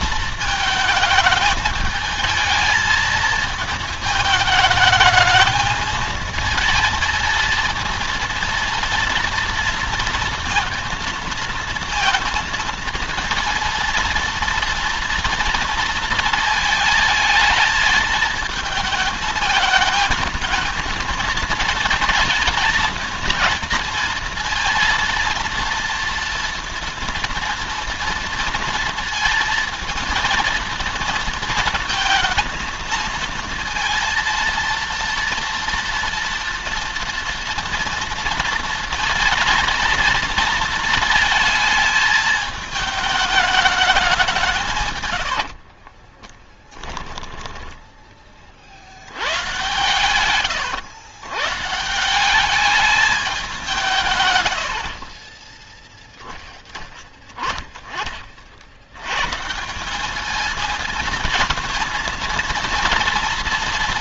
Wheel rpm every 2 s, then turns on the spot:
220, 220, 210, 230, 230, 230, 230, 230, 220, 220, 220, 220, 230, 230, 230, 230, 230, 230, 230, 230, 230, 210, 160, 10, 60, 120, 200, 80, 10, 70, 220, 220.
44-48